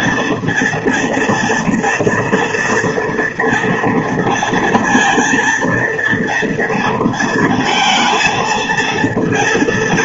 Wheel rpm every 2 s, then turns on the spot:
240, 230, 230, 230, 230.
none